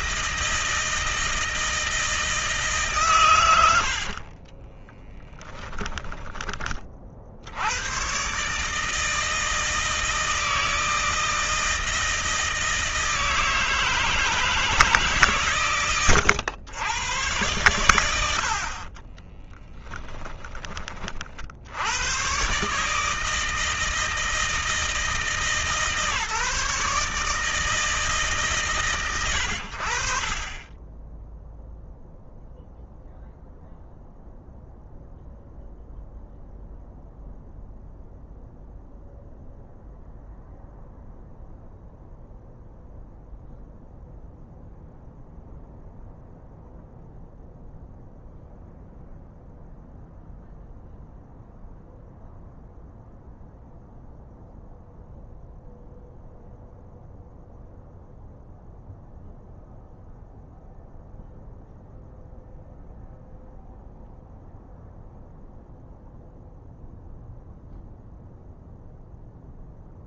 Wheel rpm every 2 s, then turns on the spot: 160, 150, 20, 40, 150, 160, 160, 150, 110, 20, 30, 150, 160, 150, 110, 20, 0, 0, 0, 0, 0, 0, 0, 0, 0, 0, 0, 0, 0, 0, 0, 0, 0, 0, 0.
4-6 18-20